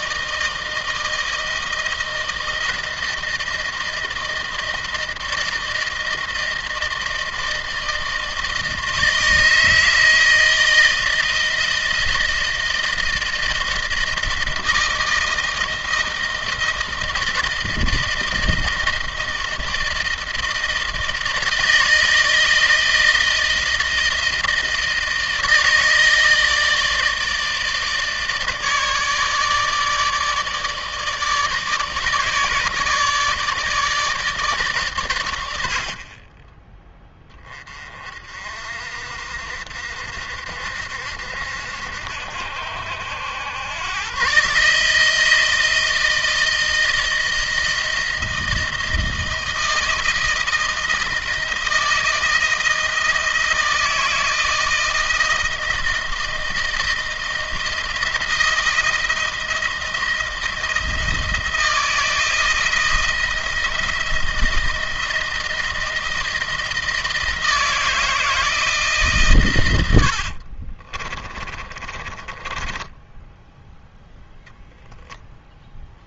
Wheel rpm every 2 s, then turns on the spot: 160, 160, 160, 160, 160, 160, 160, 160, 160, 160, 160, 160, 160, 160, 150, 150, 150, 140, 20, 50, 70, 80, 150, 160, 160, 170, 160, 160, 160, 160, 160, 170, 160, 160, 150, 40, 20, 0.
70-74